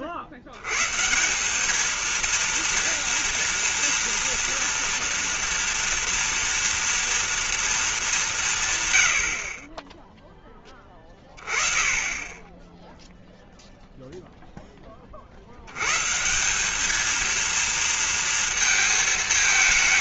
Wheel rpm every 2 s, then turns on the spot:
100, 230, 230, 230, 140, 10, 10, 10, 180, 230.
none